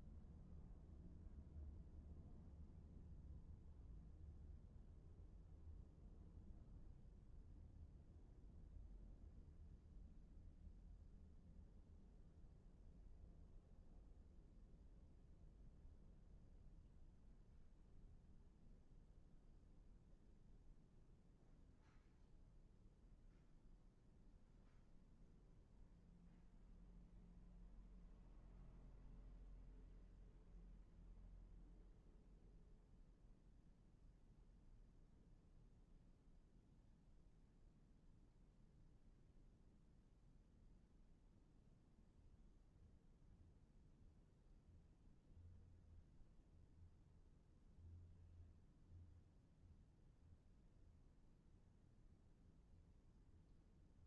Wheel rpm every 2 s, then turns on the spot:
0, 0, 0, 0, 0, 0, 0, 0, 0, 0, 0, 0, 0, 0, 0, 0, 0, 0, 0, 0, 0, 0, 0, 0, 0, 0, 0.
none